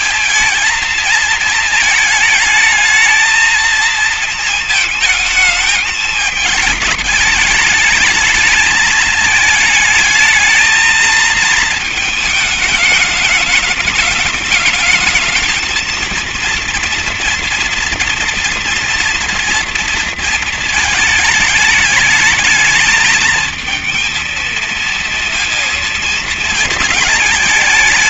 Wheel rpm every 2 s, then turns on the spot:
220, 220, 220, 210, 220, 220, 210, 220, 240, 230, 220, 220, 230, 220.
none